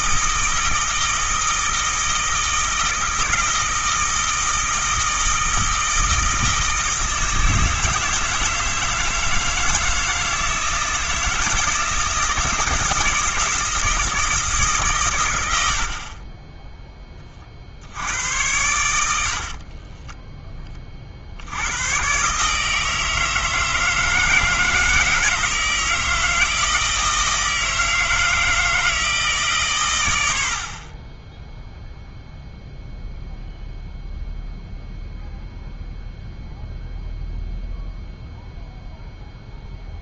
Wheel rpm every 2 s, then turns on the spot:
160, 160, 160, 160, 160, 160, 160, 130, 10, 90, 30, 160, 160, 160, 160, 40, 0, 0, 0, 0.
none